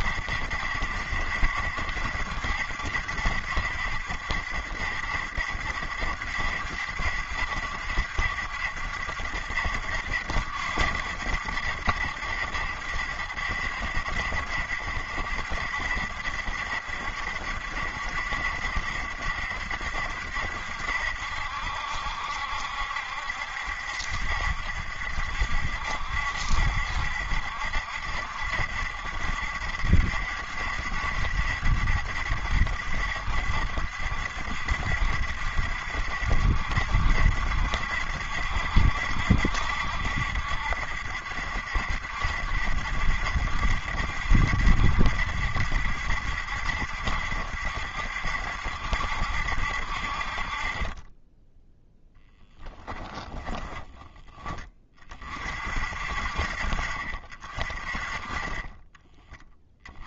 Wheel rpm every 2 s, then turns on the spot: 70, 70, 70, 70, 70, 70, 70, 60, 70, 70, 70, 70, 70, 70, 70, 70, 70, 70, 70, 70, 60, 70, 70, 70, 70, 40, 10, 20, 60, 30.
52-54